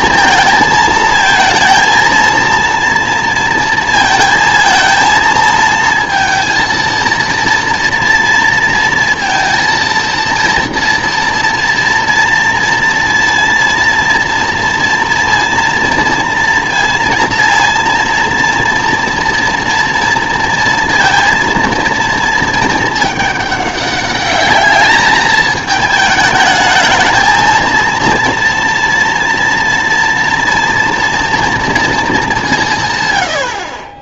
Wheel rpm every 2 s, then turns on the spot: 220, 230, 230, 230, 230, 230, 230, 230, 230, 230, 230, 220, 210, 220, 230, 230, 170.
none